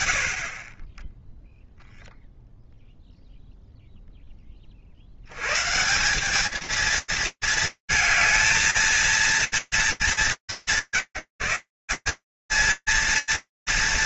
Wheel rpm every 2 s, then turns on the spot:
40, 0, 110, 230, 230, 160, 220.
none